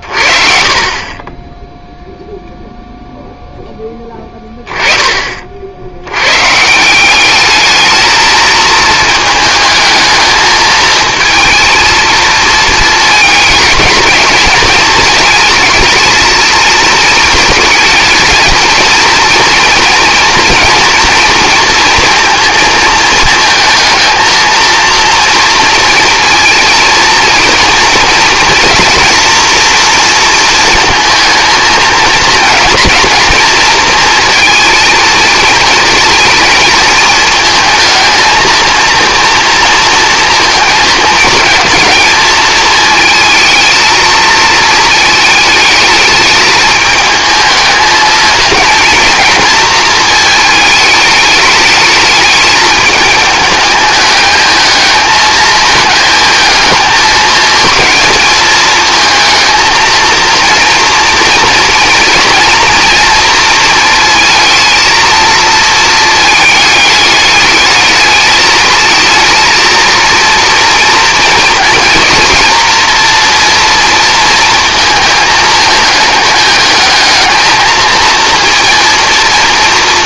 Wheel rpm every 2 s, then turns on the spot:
30, 0, 10, 160, 220, 220, 220, 220, 220, 230, 240, 230, 230, 230, 240, 230, 230, 230, 220, 230, 220, 220, 230, 210, 230, 210, 210, 220, 220, 220, 240, 240, 230, 210, 220, 230, 230, 230, 210, 230.
none